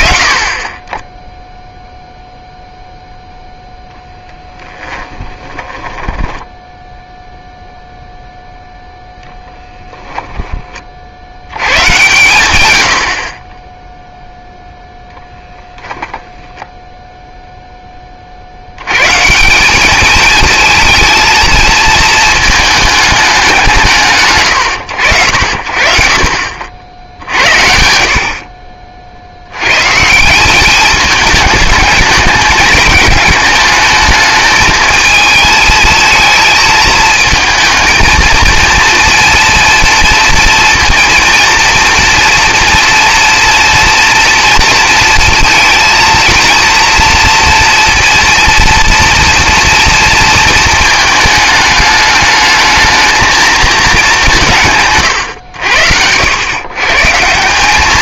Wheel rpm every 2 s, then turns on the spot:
30, 0, 10, 0, 0, 20, 90, 10, 0, 110, 230, 220, 80, 60, 40, 200, 210, 220, 220, 230, 230, 230, 230, 230, 230, 220, 220, 150, 120.
4-6